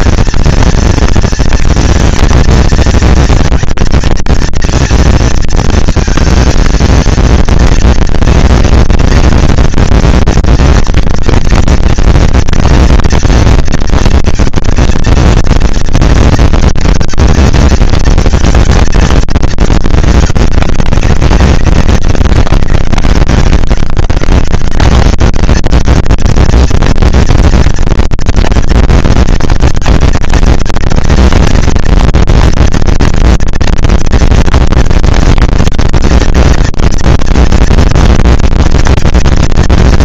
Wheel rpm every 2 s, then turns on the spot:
230, 230, 230, 230, 230, 230, 230, 230, 230, 220, 210, 130, 130, 220, 230, 230, 230, 230, 220, 230.
none